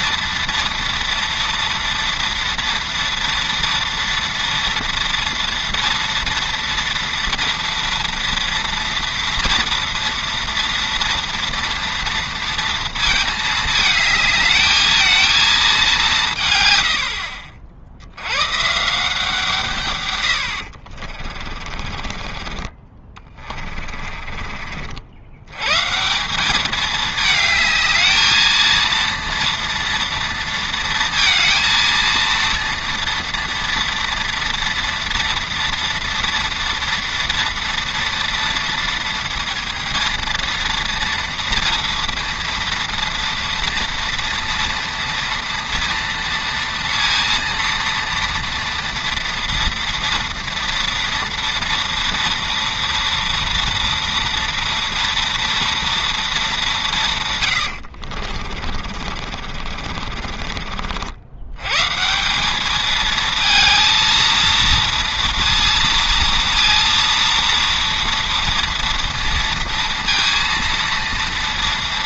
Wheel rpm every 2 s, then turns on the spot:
230, 230, 230, 230, 230, 230, 230, 220, 110, 140, 60, 30, 50, 200, 230, 230, 230, 230, 230, 230, 230, 230, 230, 230, 230, 230, 230, 230, 190, 50, 50, 200, 230, 230, 230, 230.
20-22 58-62